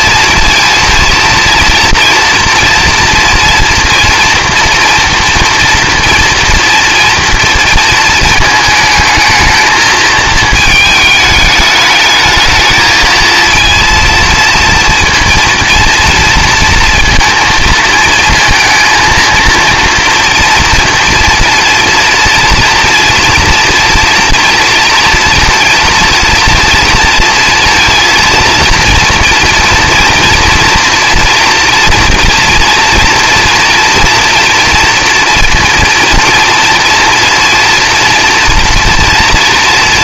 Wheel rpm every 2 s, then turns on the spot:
230, 230, 230, 230, 220, 220, 220, 230, 230, 230, 230, 230, 230, 230, 230, 230, 230, 230, 230, 230.
none